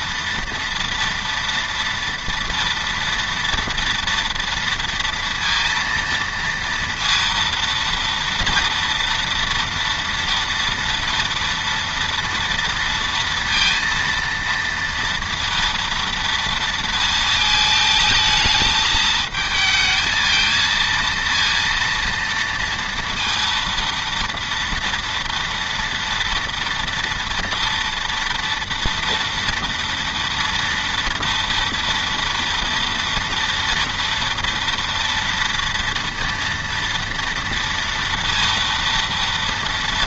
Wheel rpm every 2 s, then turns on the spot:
230, 230, 230, 230, 230, 230, 230, 230, 230, 220, 230, 230, 230, 230, 230, 230, 230, 230, 240, 230.
none